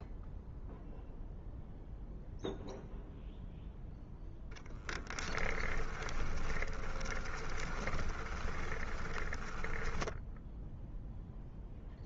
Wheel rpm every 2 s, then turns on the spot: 0, 0, 10, 20, 30, 0.
4-10